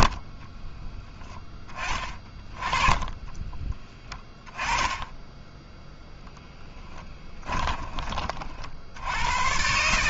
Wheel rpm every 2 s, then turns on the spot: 40, 20, 20, 10, 60.
0-8